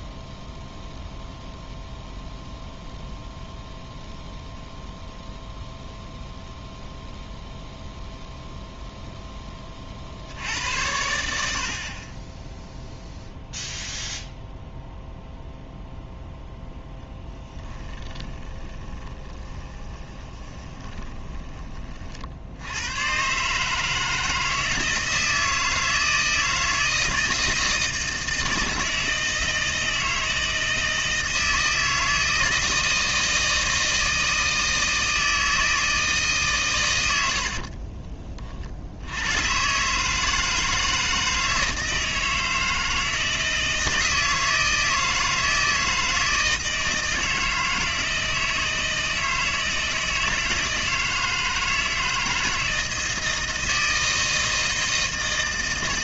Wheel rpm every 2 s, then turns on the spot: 0, 0, 0, 0, 0, 70, 10, 0, 0, 10, 20, 60, 160, 160, 160, 160, 160, 160, 130, 40, 160, 160, 160, 160, 160, 160, 160, 160.
18-22